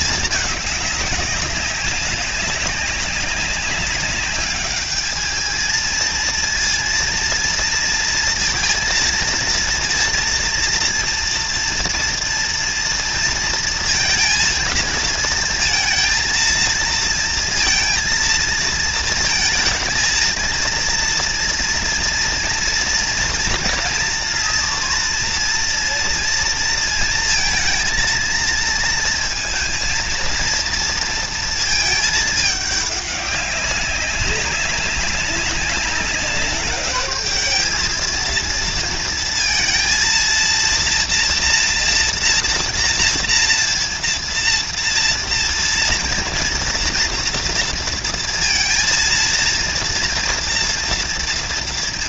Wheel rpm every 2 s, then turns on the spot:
210, 190, 210, 230, 230, 230, 230, 230, 230, 230, 230, 230, 230, 230, 230, 230, 200, 190, 210, 230, 240, 240, 230, 230, 230, 240.
none